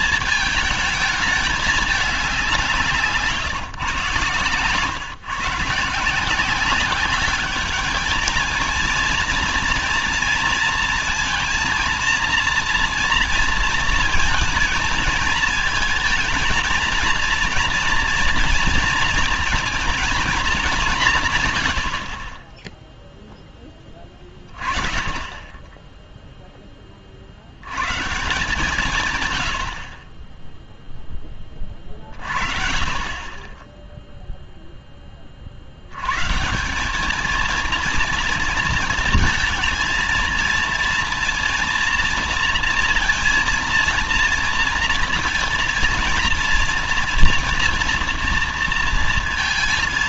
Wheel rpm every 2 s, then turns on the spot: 220, 190, 130, 170, 230, 230, 240, 230, 230, 230, 210, 30, 20, 10, 160, 10, 40, 0, 150, 230, 230, 230, 230, 230, 230.
none